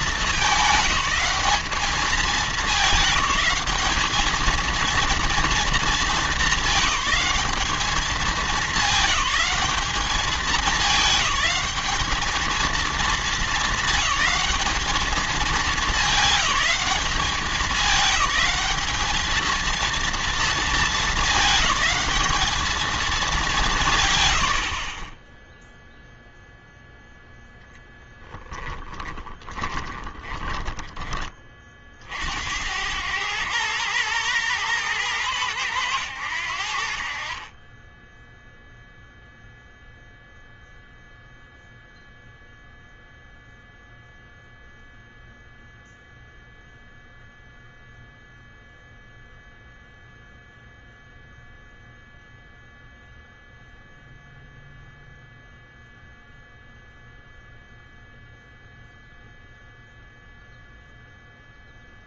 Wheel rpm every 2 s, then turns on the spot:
210, 210, 220, 200, 200, 210, 220, 220, 210, 210, 220, 220, 70, 0, 20, 20, 90, 110, 70, 0, 0, 0, 0, 0, 0, 0, 0, 0, 0, 0, 0.
28-30